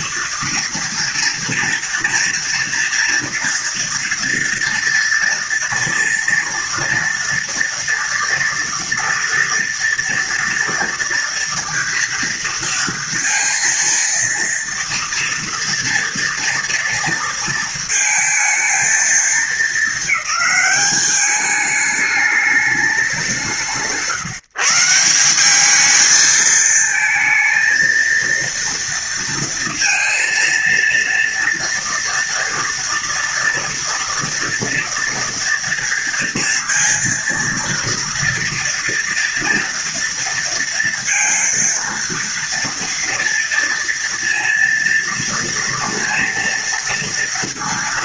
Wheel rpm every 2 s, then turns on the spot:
230, 240, 230, 230, 230, 230, 230, 230, 230, 220, 210, 210, 170, 220, 230, 230, 230, 230, 230, 230, 230, 230, 230, 230.
none